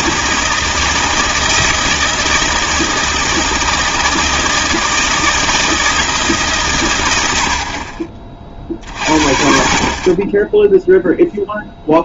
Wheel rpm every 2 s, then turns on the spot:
160, 160, 160, 130, 40, 10.
none